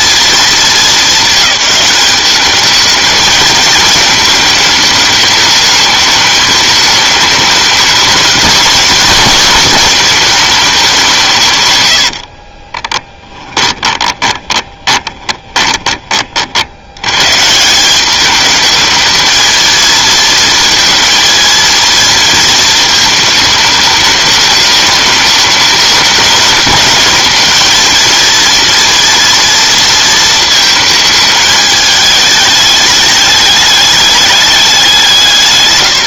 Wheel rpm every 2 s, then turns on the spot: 220, 210, 220, 210, 230, 210, 40, 20, 70, 220, 230, 220, 210, 210, 230, 230, 210, 200.
12-16